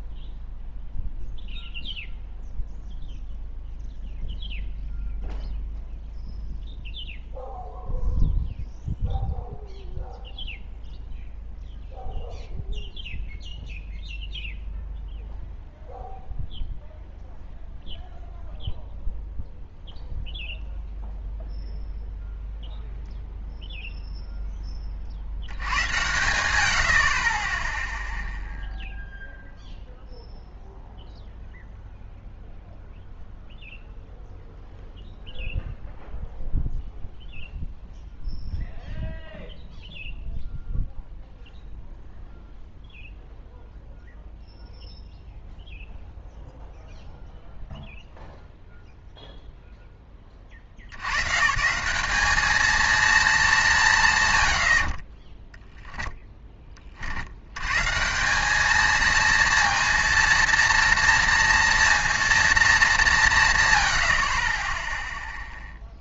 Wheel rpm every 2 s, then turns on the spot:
0, 0, 0, 0, 0, 0, 0, 0, 0, 0, 0, 0, 10, 90, 0, 0, 0, 0, 0, 0, 0, 0, 0, 0, 0, 30, 210, 90, 10, 190, 230, 220, 30.
none